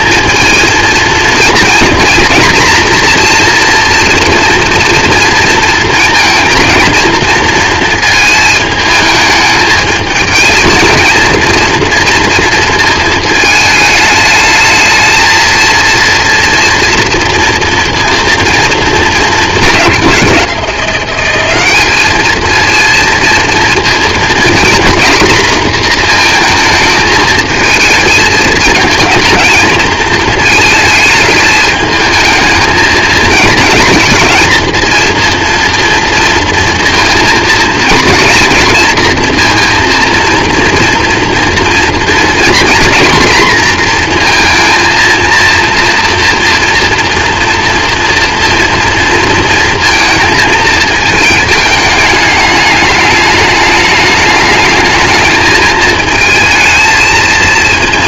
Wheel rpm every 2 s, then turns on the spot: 230, 240, 230, 230, 220, 220, 230, 220, 230, 220, 180, 220, 240, 220, 220, 220, 220, 230, 230, 230, 230, 240, 230, 230, 230, 220, 210, 210, 220.
none